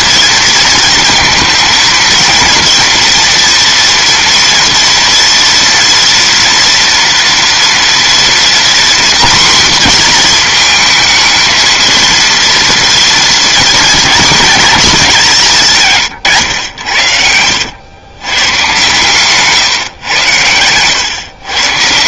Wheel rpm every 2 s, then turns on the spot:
230, 230, 230, 230, 240, 230, 230, 220, 110, 130, 110.
none